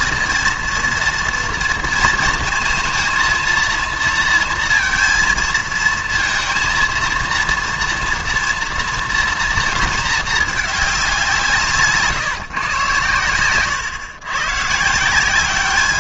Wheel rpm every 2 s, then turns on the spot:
230, 230, 230, 230, 230, 210, 130, 150.
none